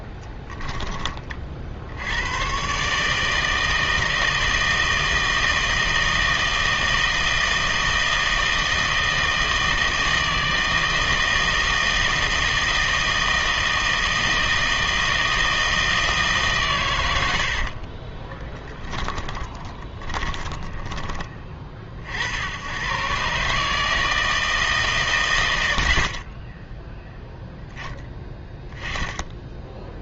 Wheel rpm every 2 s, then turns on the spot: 10, 130, 160, 160, 160, 160, 160, 160, 120, 20, 20, 90, 150, 10, 10.
18-22